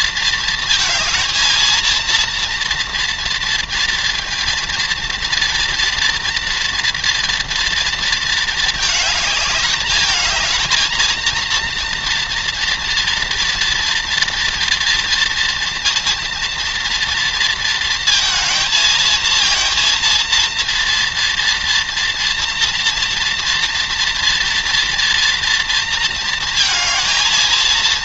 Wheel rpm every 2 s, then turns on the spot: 220, 230, 230, 230, 220, 220, 230, 230, 230, 230, 230, 230, 230, 230.
none